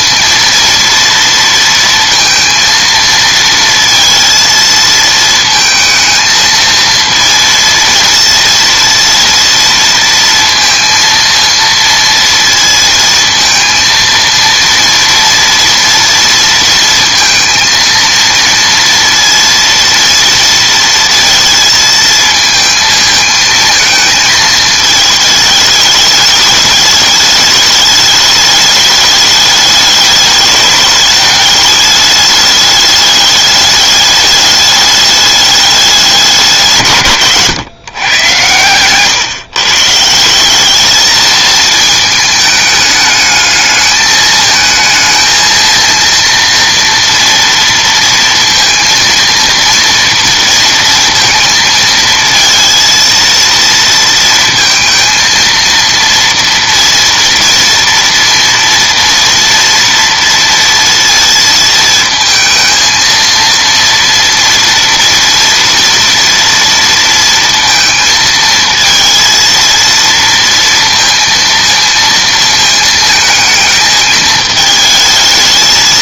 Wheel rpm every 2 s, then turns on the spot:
230, 230, 230, 220, 230, 230, 230, 230, 230, 230, 230, 220, 220, 210, 210, 210, 210, 210, 160, 120, 200, 210, 220, 230, 230, 230, 230, 230, 230, 230, 230, 220, 240, 230, 230, 230, 220, 220.
none